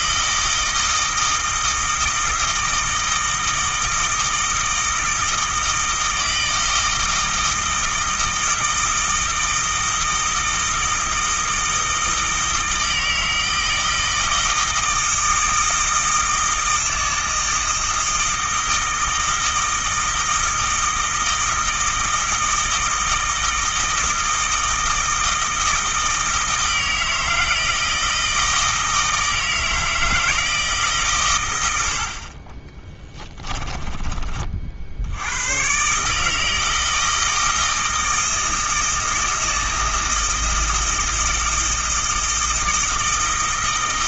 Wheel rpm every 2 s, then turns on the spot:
160, 160, 160, 160, 160, 160, 160, 160, 160, 160, 160, 160, 160, 160, 160, 140, 20, 70, 160, 160, 160, 160.
32-34